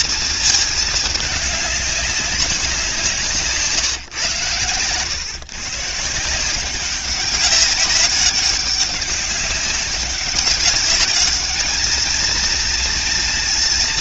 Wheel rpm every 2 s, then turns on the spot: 220, 170, 120, 190, 200, 200, 230.
none